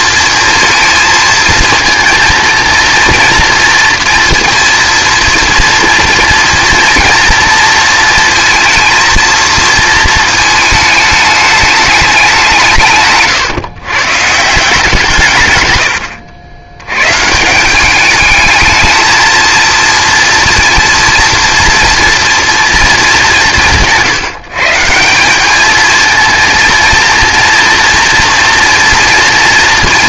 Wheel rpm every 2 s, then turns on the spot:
230, 230, 230, 230, 230, 220, 160, 170, 100, 220, 230, 220, 160, 230, 240.
none